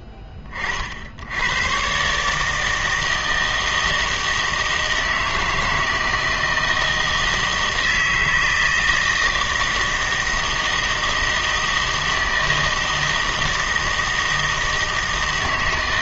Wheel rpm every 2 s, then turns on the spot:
40, 160, 160, 160, 160, 160, 160, 160.
none